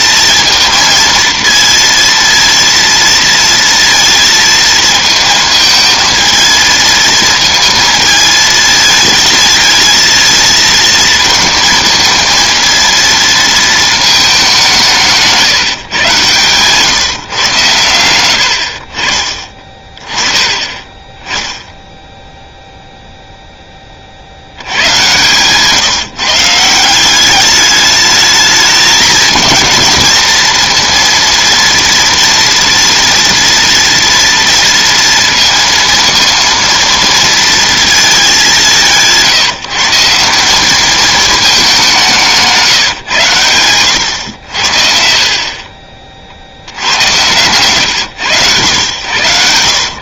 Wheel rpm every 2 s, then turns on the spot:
230, 230, 220, 220, 220, 230, 230, 200, 140, 60, 20, 0, 80, 170, 210, 230, 240, 230, 230, 180, 200, 160, 70, 60, 110.
none